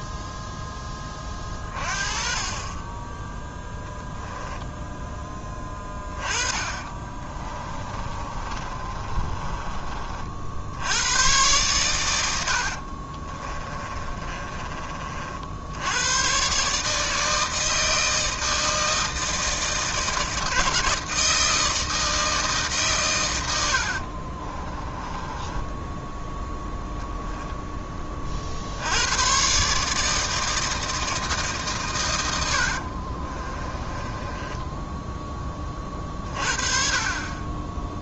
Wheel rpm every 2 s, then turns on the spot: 10, 20, 0, 30, 30, 80, 60, 30, 140, 160, 160, 140, 30, 10, 70, 160, 70, 10, 40.
6-10 12-16 24-26 32-36